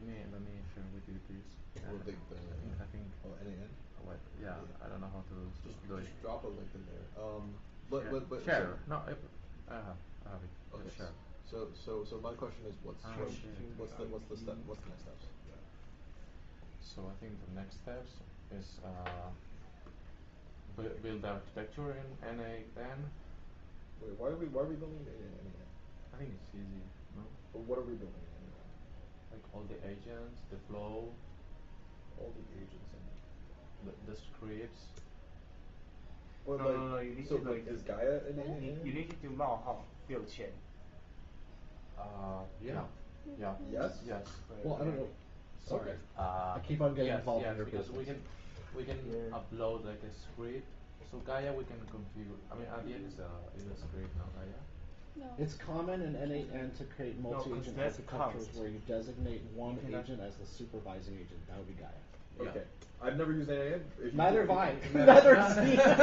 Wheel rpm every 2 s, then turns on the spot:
0, 0, 0, 0, 0, 0, 0, 0, 0, 0, 0, 0, 0, 0, 0, 0, 0, 0, 0, 0, 0, 0, 0, 0, 0, 0, 0, 0, 0, 0, 0, 0, 0.
none